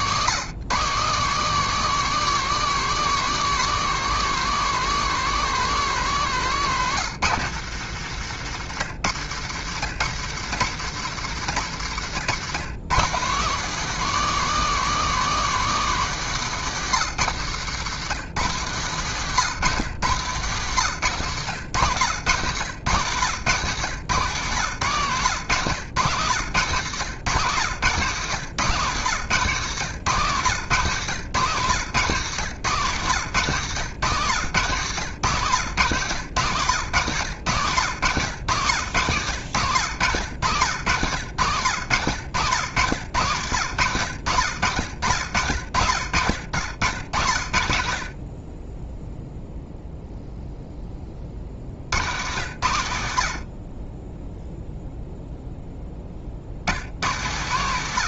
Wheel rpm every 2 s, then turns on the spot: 180, 220, 190, 150, 110, 140, 160, 230, 150, 140, 140, 120, 130, 110, 130, 130, 120, 130, 110, 90, 90, 90, 70, 70, 10, 20, 70, 0, 100.
6-8